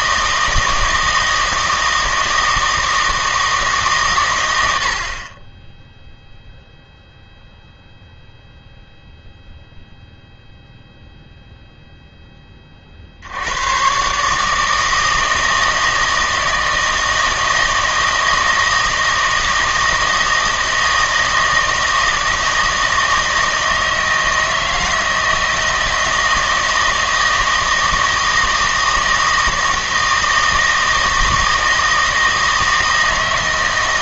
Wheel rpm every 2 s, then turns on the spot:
160, 160, 80, 0, 0, 0, 40, 160, 160, 160, 160, 160, 160, 160, 160, 160, 160.
none